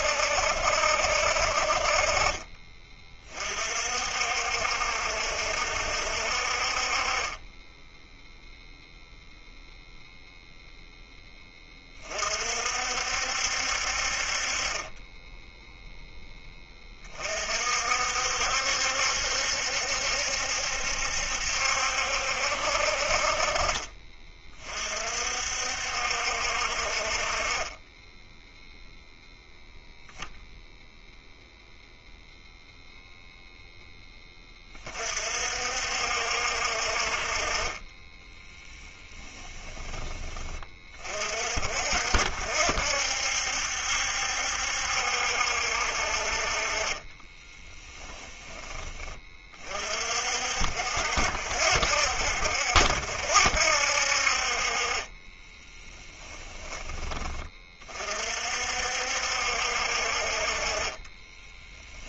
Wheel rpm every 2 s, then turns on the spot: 70, 30, 60, 40, 0, 0, 60, 30, 20, 70, 70, 50, 50, 50, 0, 0, 0, 30, 50, 10, 30, 60, 70, 30, 20, 60, 70, 30, 10, 60, 30.
38-40 46-48 54-56 60-62